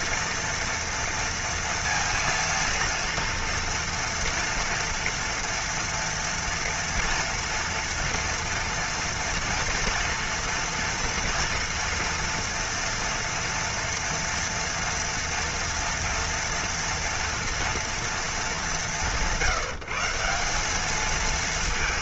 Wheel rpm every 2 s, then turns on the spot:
230, 230, 230, 230, 230, 230, 230, 230, 230, 180, 200.
none